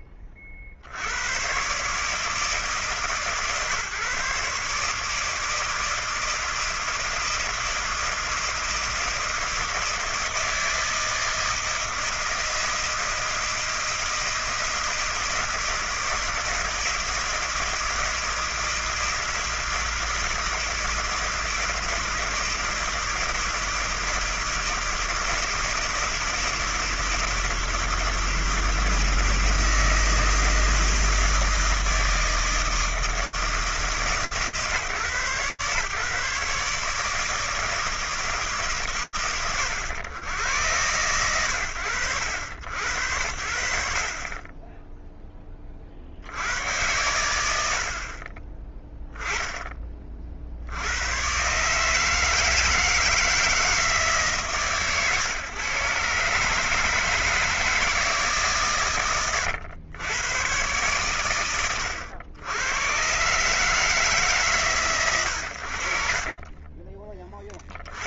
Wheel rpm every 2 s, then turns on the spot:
50, 150, 150, 160, 160, 160, 160, 160, 160, 160, 160, 160, 160, 160, 160, 160, 160, 140, 150, 110, 90, 80, 10, 90, 0, 120, 160, 130, 160, 120, 120, 120, 140, 40.
66-68